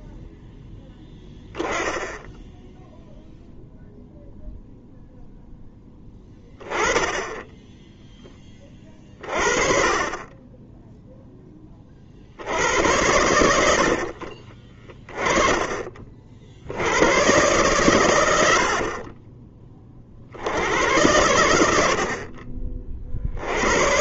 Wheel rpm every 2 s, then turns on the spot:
0, 0, 0, 10, 20, 10, 80, 50, 60, 80, 70, 40.
14-16